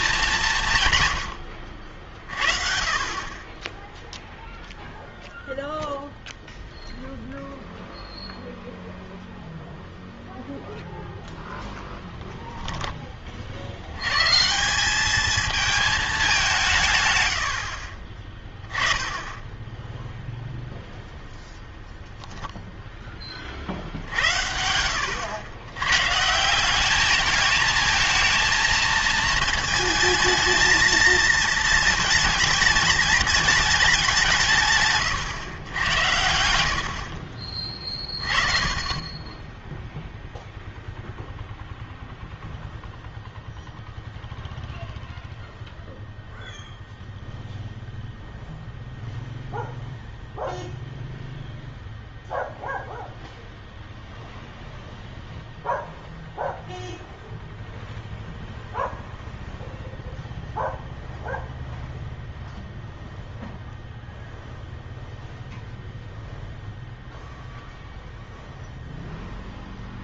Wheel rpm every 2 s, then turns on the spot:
160, 40, 0, 0, 0, 0, 10, 180, 160, 20, 0, 0, 90, 190, 220, 230, 220, 150, 60, 30, 0, 0, 0, 0, 0, 0, 0, 0, 0, 0, 0, 0, 0, 0, 0.
12-14